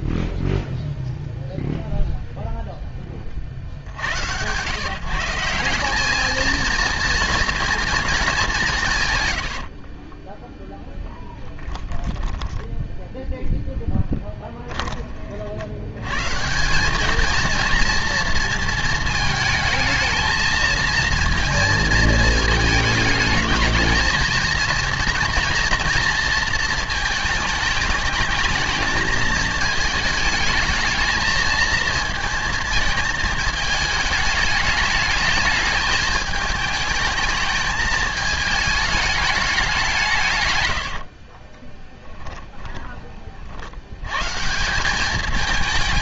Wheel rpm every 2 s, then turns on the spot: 0, 0, 120, 230, 190, 10, 10, 20, 160, 230, 230, 220, 230, 230, 220, 220, 230, 210, 220, 220, 100, 20, 150.
10-12 14-16 42-44